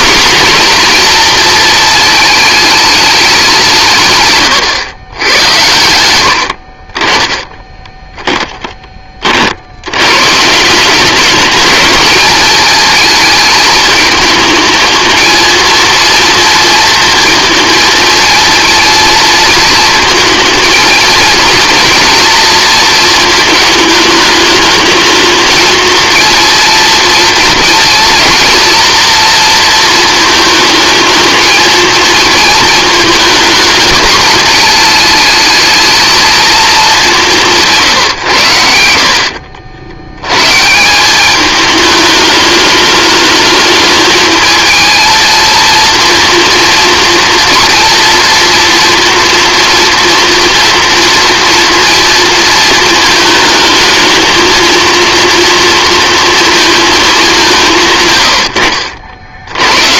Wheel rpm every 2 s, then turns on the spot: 250, 210, 120, 50, 20, 180, 220, 220, 230, 230, 230, 230, 220, 230, 230, 220, 230, 230, 210, 90, 150, 220, 220, 240, 230, 230, 220, 230, 230, 70.
38-40